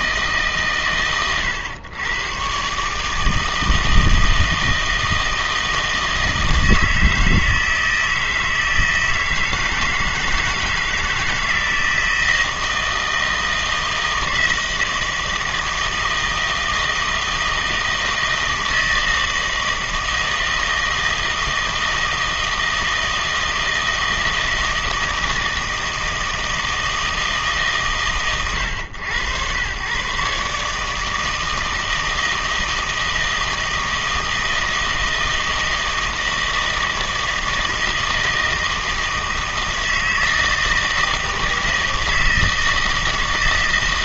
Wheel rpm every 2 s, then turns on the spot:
140, 130, 160, 160, 160, 160, 160, 160, 160, 160, 160, 160, 160, 160, 110, 150, 160, 160, 160, 160, 160, 160.
none